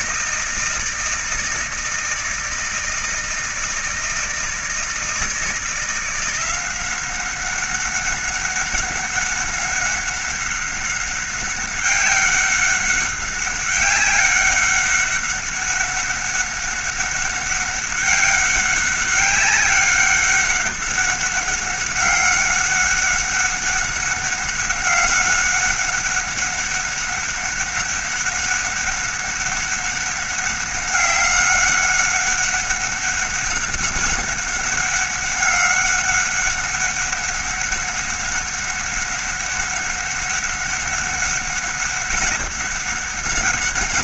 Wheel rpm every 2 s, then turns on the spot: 160, 160, 160, 180, 200, 190, 190, 200, 190, 190, 200, 200, 190, 190, 190, 190, 190, 200, 190, 200, 200, 200.
none